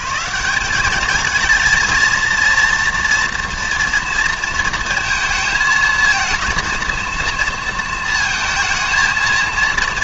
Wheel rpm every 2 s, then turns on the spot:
200, 230, 230, 230, 220.
none